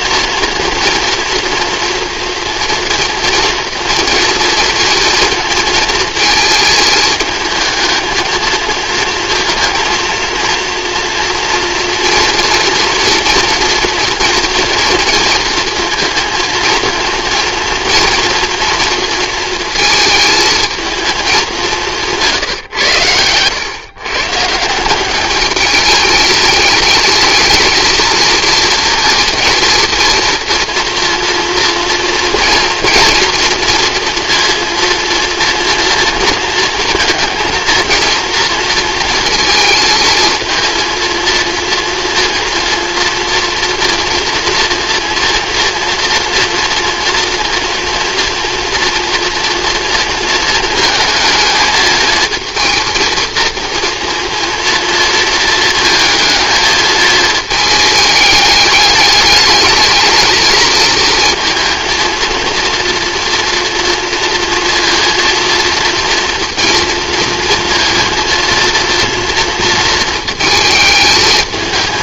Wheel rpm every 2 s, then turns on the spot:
230, 230, 230, 220, 230, 230, 240, 230, 230, 230, 220, 140, 170, 210, 230, 240, 240, 230, 230, 230, 230, 230, 230, 230, 230, 220, 230, 230, 220, 210, 220, 230, 230, 230, 230, 220.
none